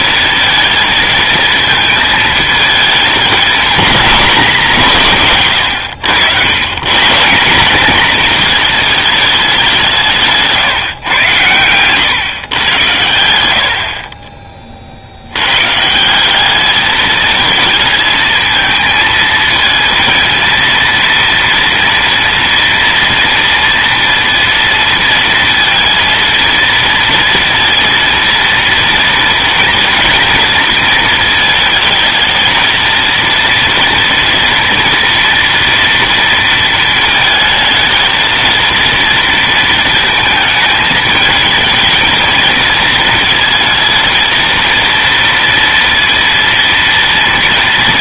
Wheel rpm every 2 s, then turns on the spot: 230, 220, 170, 150, 220, 130, 100, 50, 210, 220, 230, 230, 230, 230, 230, 230, 230, 230, 220, 230, 220, 220, 230, 230.
none